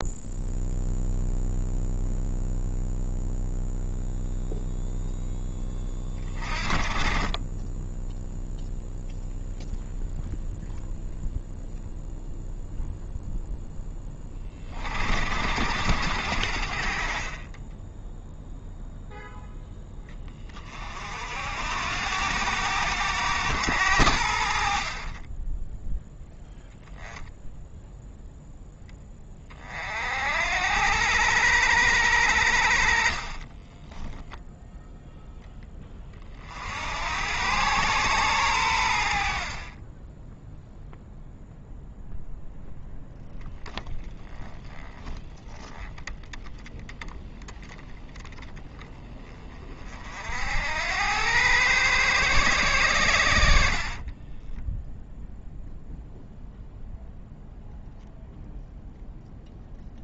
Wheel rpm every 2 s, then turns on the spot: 0, 0, 0, 30, 0, 0, 0, 50, 50, 0, 50, 110, 40, 0, 10, 90, 50, 0, 80, 90, 0, 0, 20, 10, 20, 90, 100, 0, 0, 0.
24-26